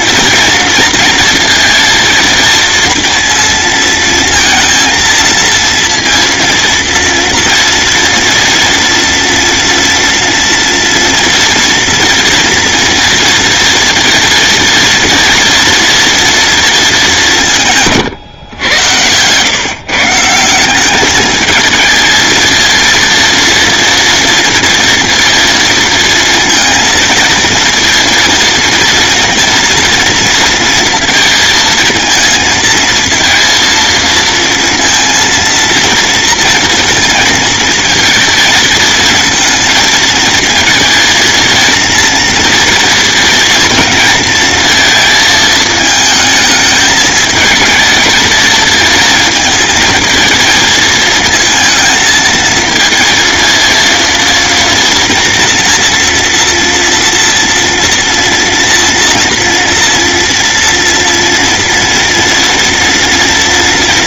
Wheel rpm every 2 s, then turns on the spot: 230, 230, 230, 230, 240, 230, 230, 240, 220, 110, 200, 230, 230, 230, 230, 230, 230, 230, 230, 220, 230, 230, 230, 220, 230, 220, 230, 230, 230, 230, 230, 230.
none